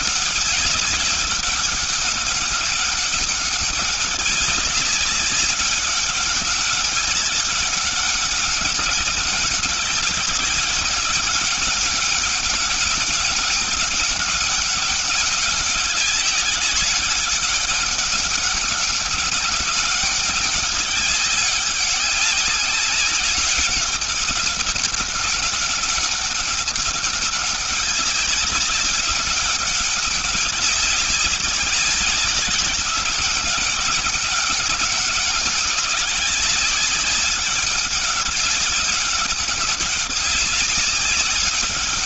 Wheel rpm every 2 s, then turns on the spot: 200, 200, 190, 200, 200, 200, 200, 190, 200, 200, 200, 190, 200, 200, 200, 200, 190, 200, 200, 200, 200.
none